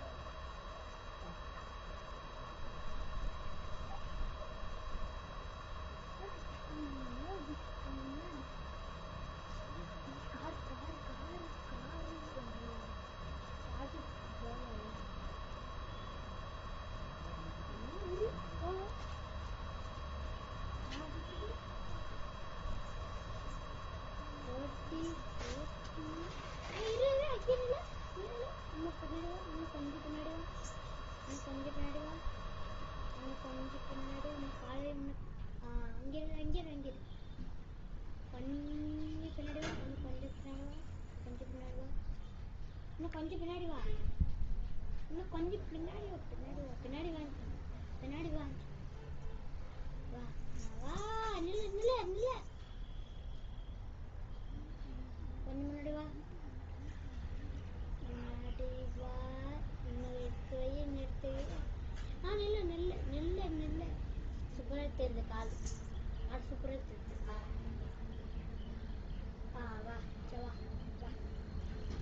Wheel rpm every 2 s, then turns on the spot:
0, 0, 0, 0, 0, 0, 0, 0, 0, 0, 0, 0, 0, 0, 0, 0, 0, 0, 0, 0, 0, 0, 0, 0, 0, 0, 0, 0, 0, 0, 0, 0, 0, 0, 0, 0.
none